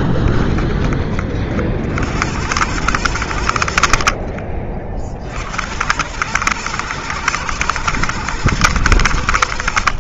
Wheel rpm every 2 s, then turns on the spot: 30, 100, 50, 120, 100.
none